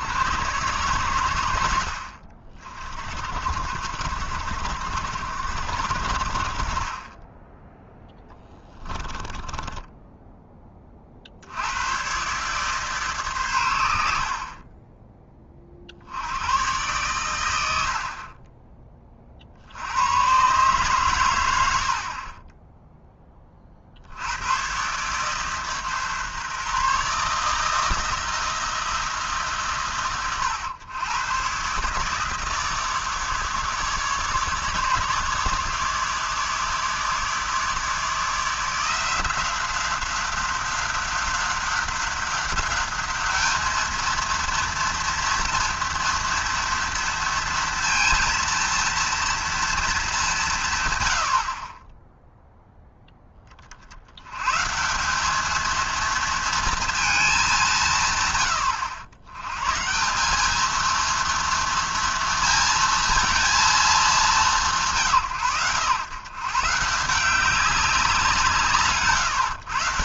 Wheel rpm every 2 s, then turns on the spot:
100, 50, 70, 40, 10, 20, 140, 20, 110, 30, 130, 10, 120, 140, 160, 100, 150, 150, 150, 170, 190, 200, 230, 230, 230, 150, 0, 150, 230, 90, 220, 230, 160, 150, 150.
8-10